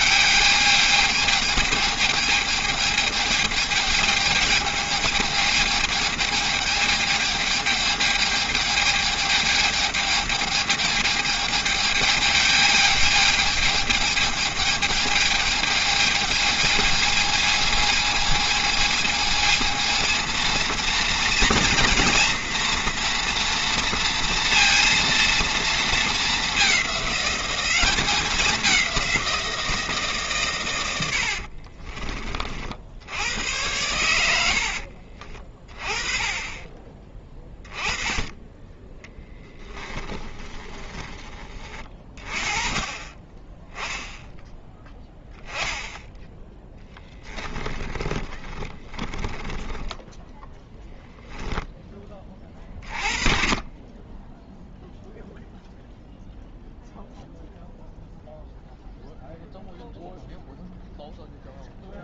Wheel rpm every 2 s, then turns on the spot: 210, 220, 210, 220, 210, 220, 220, 210, 220, 220, 230, 230, 230, 200, 190, 80, 70, 60, 20, 30, 20, 30, 10, 10, 20, 10, 40, 0, 0, 0, 0.
30-32 34-36 38-42 46-50